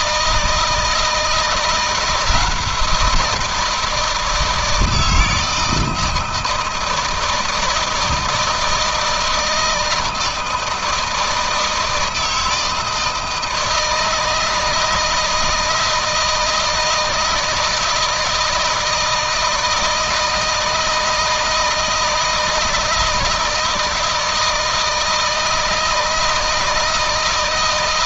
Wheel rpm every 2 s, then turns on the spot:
160, 170, 160, 160, 160, 160, 160, 160, 160, 160, 160, 160, 160, 160.
none